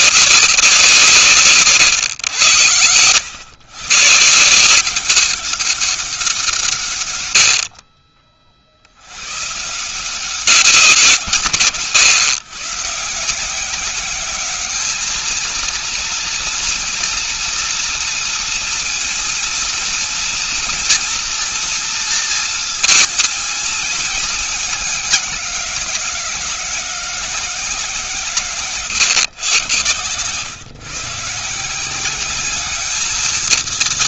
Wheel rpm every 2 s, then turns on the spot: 180, 100, 180, 140, 80, 170, 150, 210, 230, 230, 230, 230, 200, 180, 130, 130, 210.
none